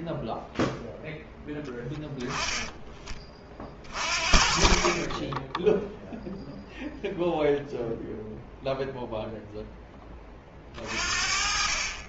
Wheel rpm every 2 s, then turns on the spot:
0, 10, 40, 0, 0, 20.
none